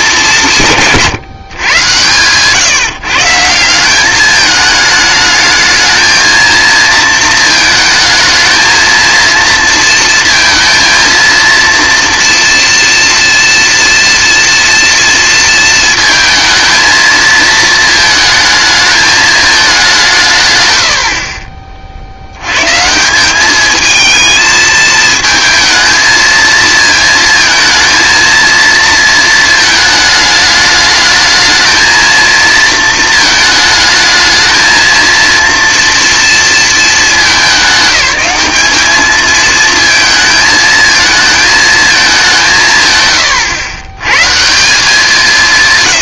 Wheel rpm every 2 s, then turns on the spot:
180, 130, 210, 220, 220, 230, 230, 240, 220, 220, 110, 120, 220, 220, 230, 210, 230, 230, 230, 210, 220, 170, 150.
none